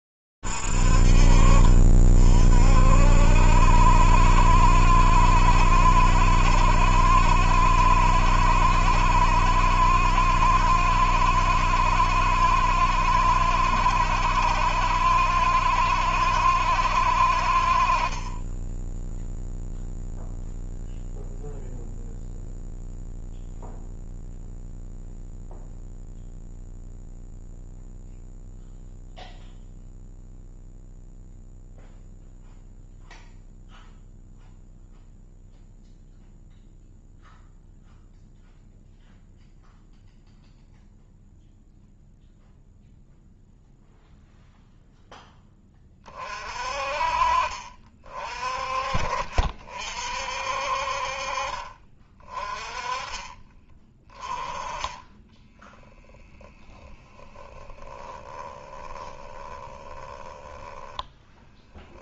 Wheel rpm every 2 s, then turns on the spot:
20, 50, 60, 70, 70, 70, 70, 70, 70, 30, 0, 0, 0, 0, 0, 0, 0, 0, 0, 0, 0, 0, 0, 40, 40, 50, 30, 20, 20, 10, 20.
56-62